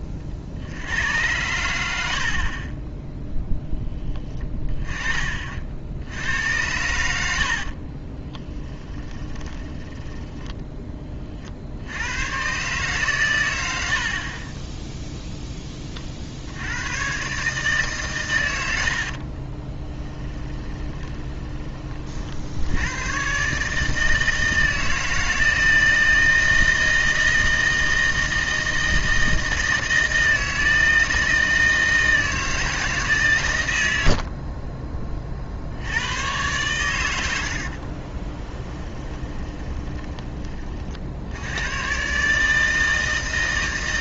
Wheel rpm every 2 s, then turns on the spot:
50, 20, 10, 80, 10, 10, 130, 20, 80, 90, 10, 80, 160, 160, 160, 160, 160, 40, 110, 20, 30, 150.
8-10 20-22 38-40